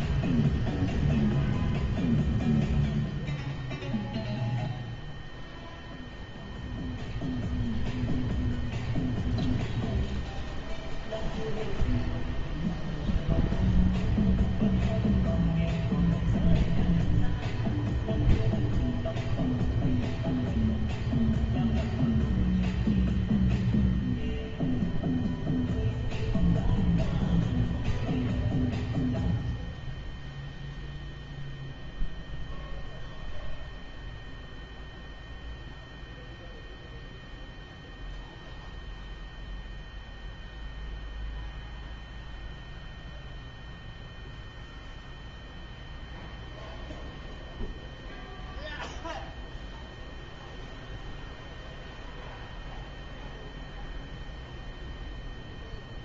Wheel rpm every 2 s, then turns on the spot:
0, 0, 0, 0, 0, 0, 0, 0, 0, 0, 0, 0, 0, 0, 0, 0, 0, 0, 0, 0, 0, 0, 0, 0, 0, 0, 0, 0.
none